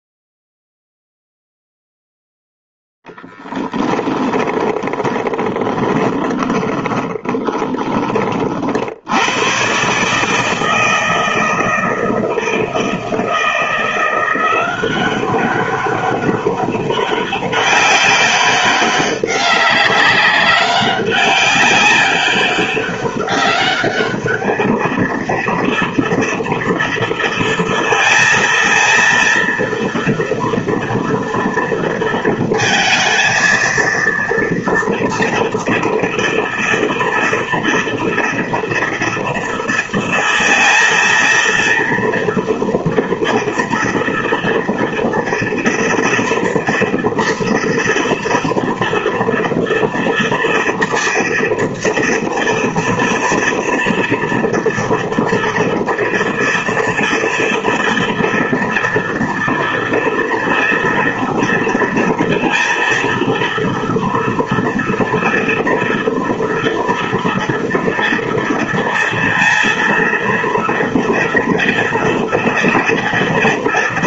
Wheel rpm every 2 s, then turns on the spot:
0, 0, 20, 20, 70, 160, 160, 190, 200, 190, 190, 200, 220, 230, 230, 230, 230, 230, 230, 230, 230, 230, 230, 230, 230, 240, 230, 230, 230, 230, 230, 230, 240, 230, 230, 230, 230.
4-8